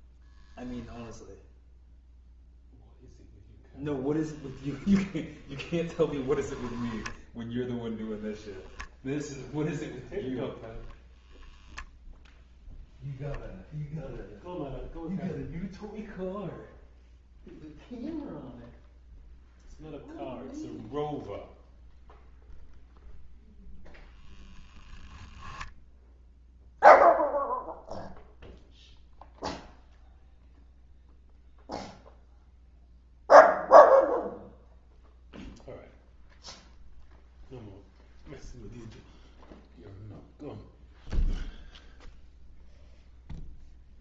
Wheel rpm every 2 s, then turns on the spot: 0, 0, 0, 0, 0, 0, 0, 0, 0, 0, 0, 0, 10, 0, 0, 0, 0, 0, 0, 0, 0, 0.
none